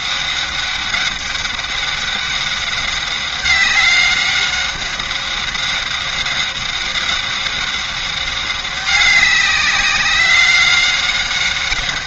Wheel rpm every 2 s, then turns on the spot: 190, 190, 190, 190, 190, 190.
none